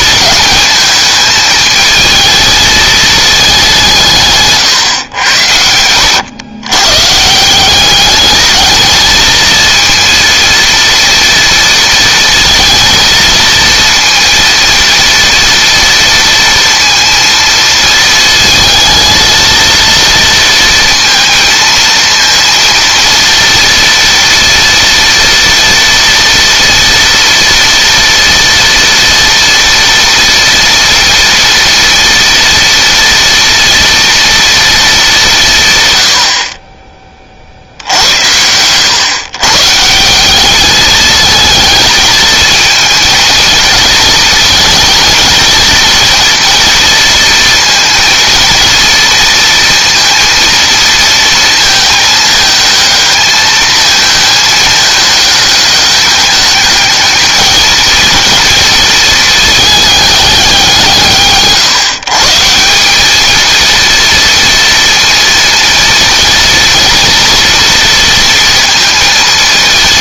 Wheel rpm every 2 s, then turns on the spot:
220, 220, 130, 130, 220, 230, 230, 230, 230, 220, 230, 230, 230, 230, 230, 230, 230, 220, 30, 110, 210, 220, 220, 230, 230, 230, 220, 210, 210, 230, 170, 190, 230, 230, 230.
none